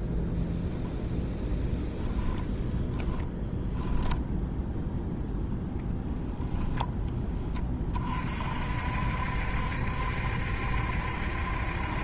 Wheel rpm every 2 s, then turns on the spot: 0, 0, 0, 0, 60, 70.
none